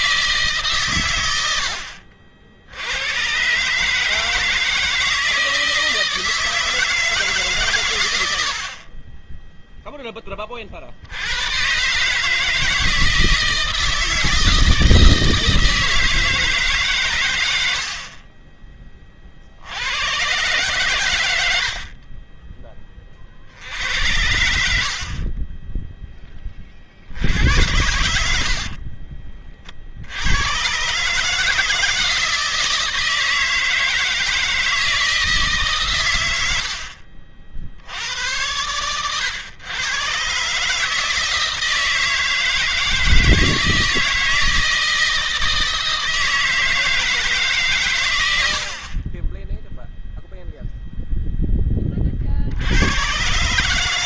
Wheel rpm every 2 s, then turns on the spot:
130, 90, 160, 160, 40, 60, 160, 160, 130, 30, 110, 30, 70, 50, 40, 130, 160, 160, 70, 100, 150, 160, 160, 160, 50, 0, 90.
28-30